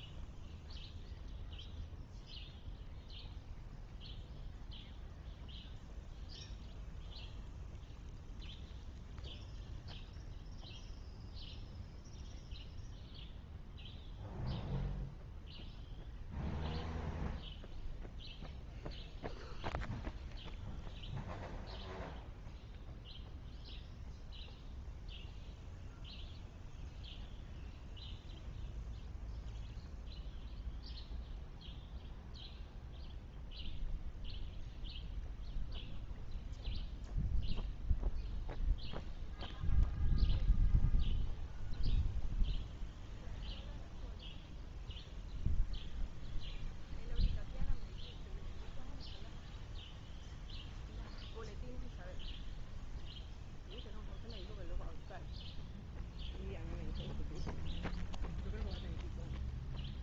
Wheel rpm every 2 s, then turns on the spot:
0, 0, 0, 0, 0, 0, 0, 0, 0, 0, 0, 0, 0, 0, 0, 0, 0, 0, 0, 0, 0, 0, 0, 0, 0, 0, 0, 0, 0, 0.
none